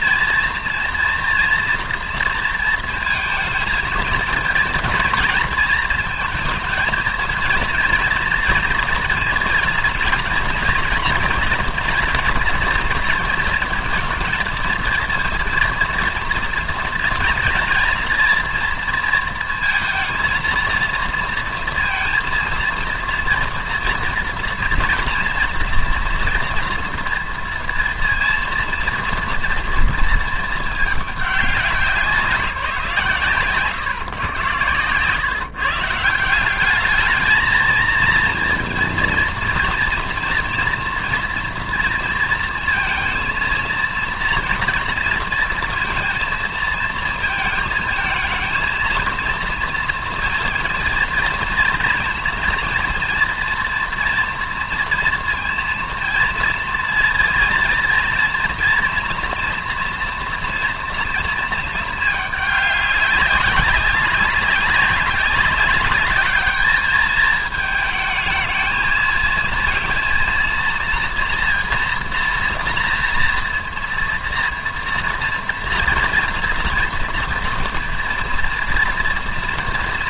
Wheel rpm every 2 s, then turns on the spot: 230, 230, 230, 220, 230, 240, 240, 230, 230, 230, 230, 230, 230, 230, 230, 220, 170, 120, 180, 230, 230, 230, 230, 230, 230, 230, 230, 230, 230, 230, 240, 210, 200, 210, 220, 230, 230, 230, 230, 230.
none